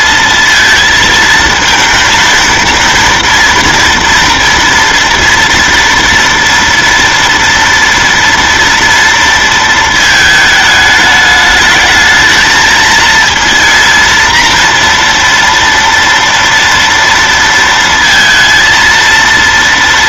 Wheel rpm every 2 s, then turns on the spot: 230, 230, 230, 230, 230, 220, 220, 230, 230, 230.
none